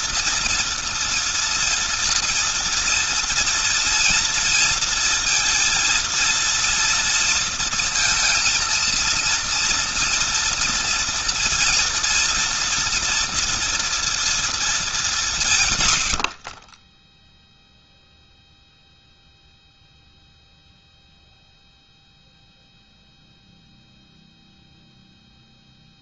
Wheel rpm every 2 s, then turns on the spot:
230, 230, 230, 230, 230, 230, 230, 190, 10, 0, 0, 0, 0.
none